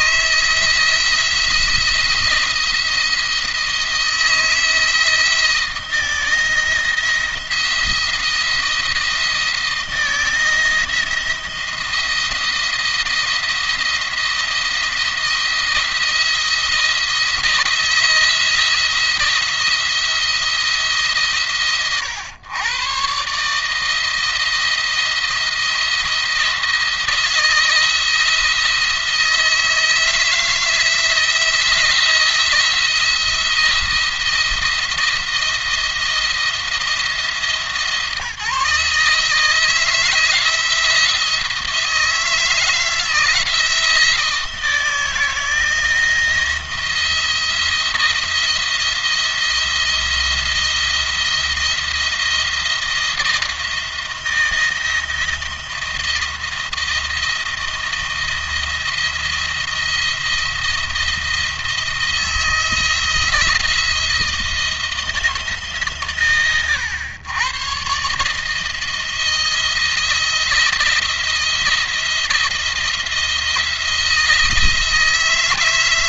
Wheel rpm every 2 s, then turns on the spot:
170, 170, 160, 170, 170, 170, 170, 170, 170, 170, 160, 120, 160, 170, 170, 160, 170, 170, 170, 150, 160, 160, 160, 170, 170, 170, 170, 170, 170, 170, 170, 160, 170, 100, 160, 170, 170, 160.
none